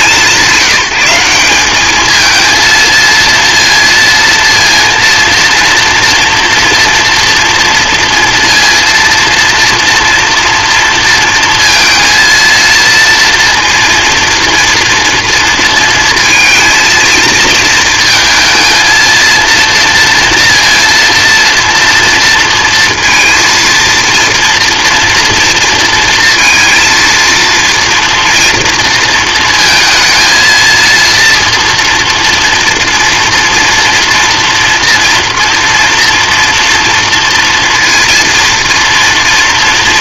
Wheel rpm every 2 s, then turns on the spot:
180, 220, 230, 230, 230, 230, 220, 230, 230, 230, 230, 230, 230, 230, 230, 230, 240, 230, 230, 230.
none